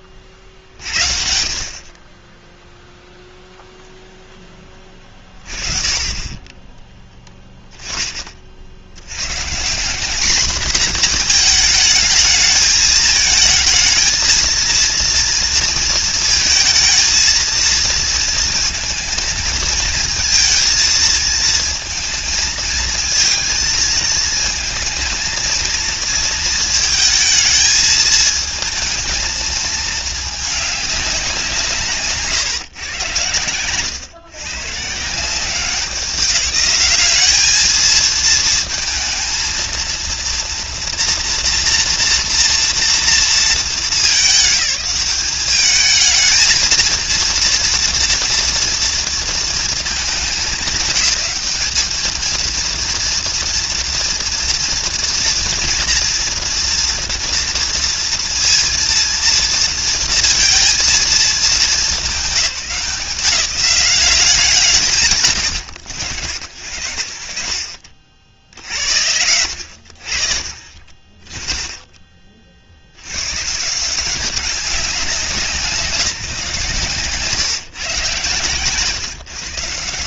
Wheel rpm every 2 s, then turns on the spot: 50, 0, 10, 10, 60, 230, 220, 230, 230, 230, 220, 230, 220, 230, 220, 210, 140, 120, 200, 230, 230, 230, 200, 220, 230, 190, 230, 230, 240, 230, 230, 190, 180, 80, 40, 50, 50, 190, 160, 140.
none